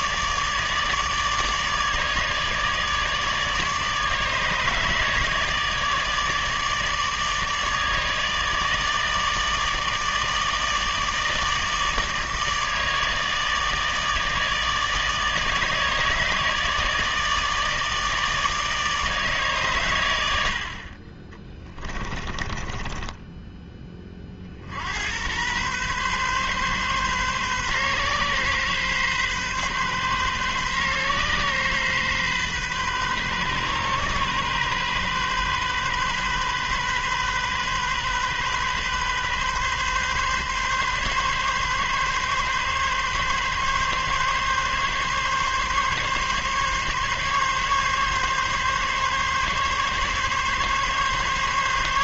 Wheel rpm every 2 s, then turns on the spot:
150, 150, 150, 150, 160, 150, 150, 150, 150, 150, 50, 20, 70, 130, 130, 130, 130, 130, 130, 130, 130, 140, 140, 140, 140, 140.
22-24